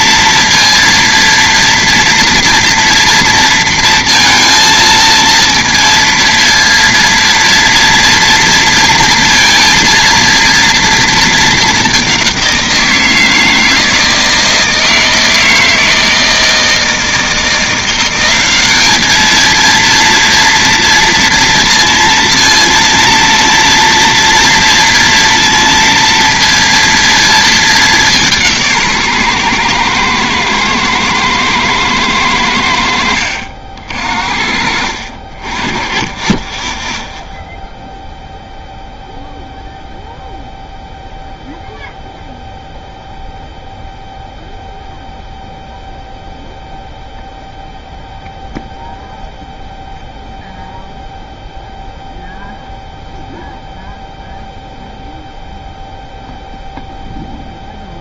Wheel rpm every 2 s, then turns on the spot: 230, 230, 230, 230, 230, 230, 180, 160, 160, 200, 230, 230, 230, 230, 160, 110, 90, 60, 10, 0, 0, 0, 0, 0, 0, 0, 0, 0, 0.
none